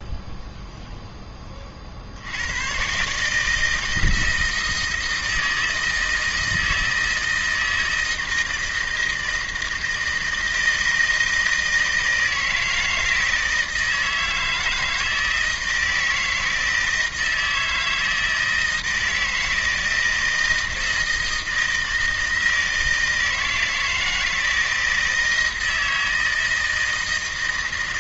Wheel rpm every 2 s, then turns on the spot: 0, 100, 160, 160, 160, 160, 160, 160, 160, 160, 160, 160, 160, 160.
none